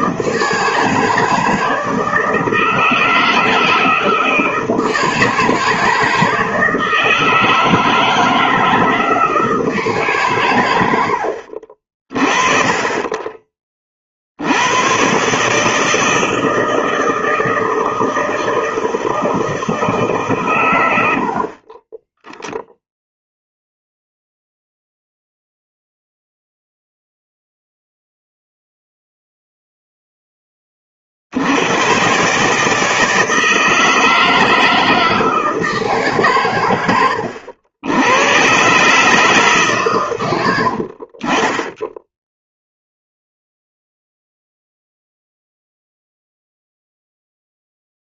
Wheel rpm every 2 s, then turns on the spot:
160, 160, 160, 160, 160, 130, 30, 80, 160, 160, 130, 0, 0, 0, 0, 10, 150, 160, 120, 110, 100, 0, 0, 0.
none